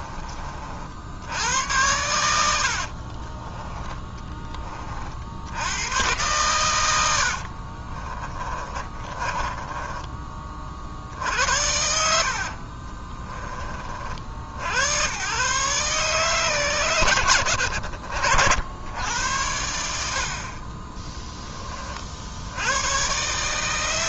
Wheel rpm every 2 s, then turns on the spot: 50, 80, 30, 110, 20, 50, 40, 80, 120, 90, 40, 90.
2-4 8-10 12-14